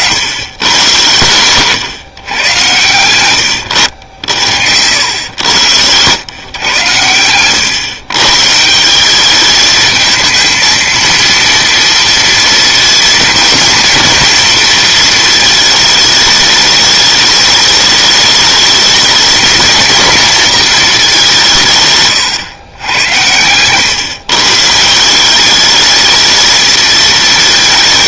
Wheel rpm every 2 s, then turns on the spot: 90, 100, 80, 120, 160, 230, 230, 230, 210, 210, 220, 110, 150, 220.
none